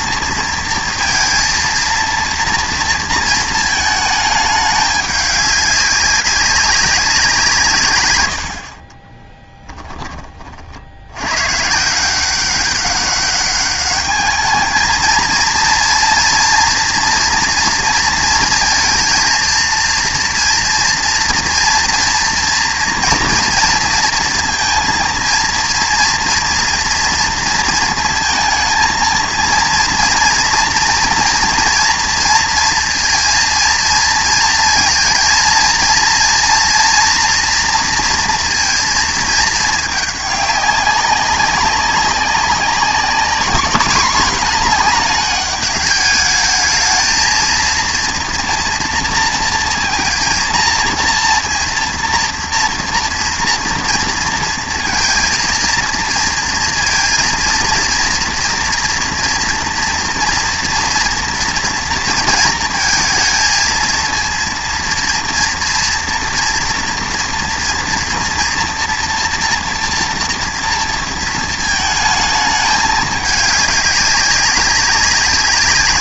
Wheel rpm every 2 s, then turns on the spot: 230, 230, 210, 200, 40, 60, 190, 220, 230, 230, 230, 230, 230, 230, 230, 230, 230, 230, 230, 230, 200, 200, 220, 220, 230, 230, 230, 230, 230, 230, 230, 230, 230, 240, 240, 230, 210, 200.
none